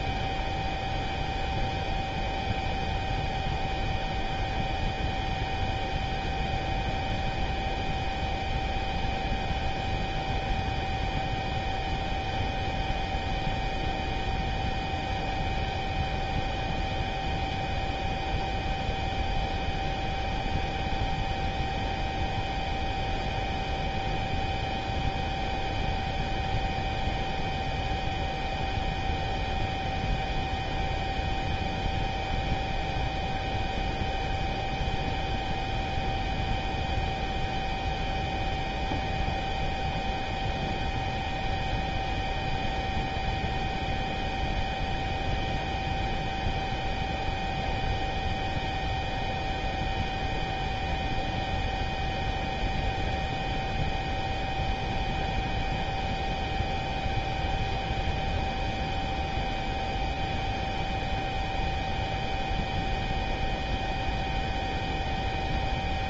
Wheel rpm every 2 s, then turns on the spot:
0, 0, 0, 0, 0, 0, 0, 0, 0, 0, 0, 0, 0, 0, 0, 0, 0, 0, 0, 0, 0, 0, 0, 0, 0, 0, 0, 0, 0, 0, 0, 0, 0.
none